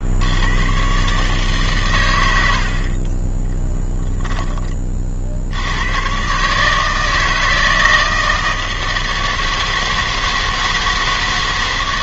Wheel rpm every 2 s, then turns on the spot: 100, 70, 30, 150, 160, 160.
4-6